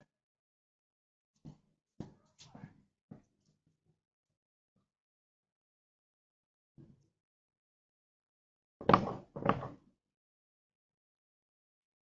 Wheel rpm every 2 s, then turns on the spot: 0, 0, 0, 0, 0, 0.
none